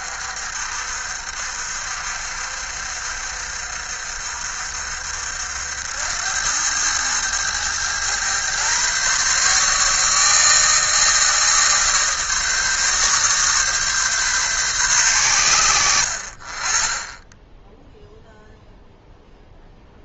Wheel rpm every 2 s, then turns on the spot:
60, 60, 70, 100, 130, 150, 140, 110, 20, 0.
none